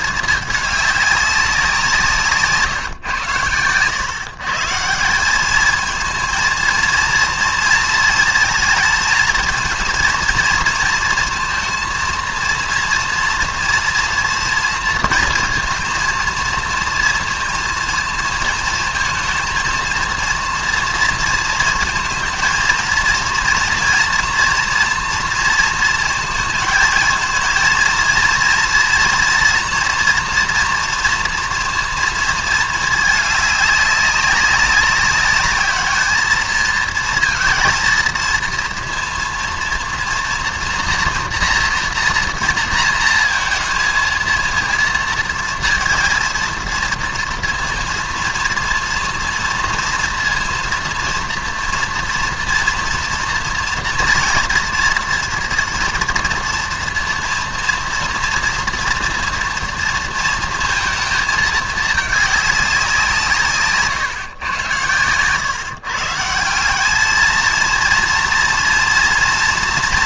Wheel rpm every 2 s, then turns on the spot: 220, 170, 120, 220, 220, 230, 230, 230, 230, 230, 230, 230, 230, 230, 230, 230, 230, 200, 220, 220, 230, 230, 230, 230, 230, 230, 230, 230, 230, 230, 230, 210, 140, 150, 230.
none